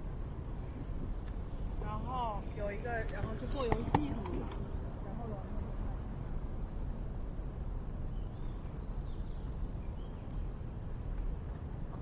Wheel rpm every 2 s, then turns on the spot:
0, 0, 0, 0, 0, 0.
none